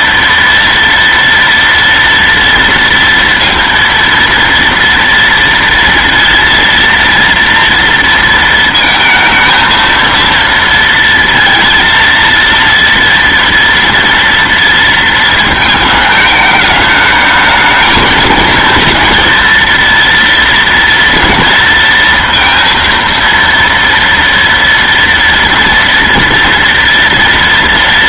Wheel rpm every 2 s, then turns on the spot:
230, 230, 230, 230, 230, 230, 230, 230, 210, 220, 230, 230, 230, 240.
none